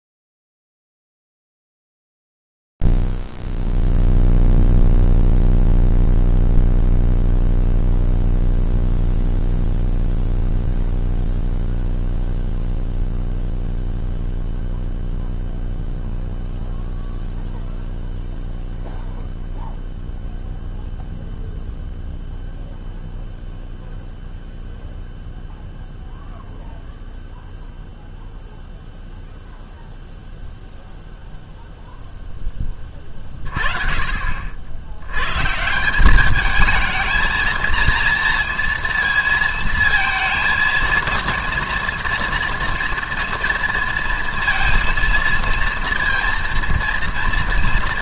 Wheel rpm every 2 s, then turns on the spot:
0, 0, 0, 0, 0, 0, 0, 0, 0, 0, 0, 0, 0, 0, 0, 0, 20, 80, 220, 230, 230, 230, 230, 230.
none